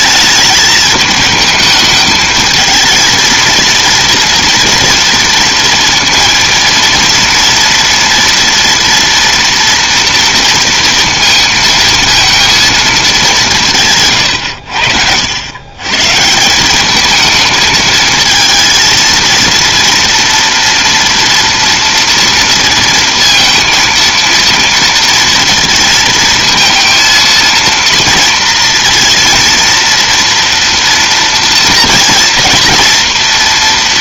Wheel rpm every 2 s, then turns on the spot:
220, 220, 230, 230, 230, 230, 220, 80, 190, 230, 230, 230, 230, 230, 230, 230, 230.
none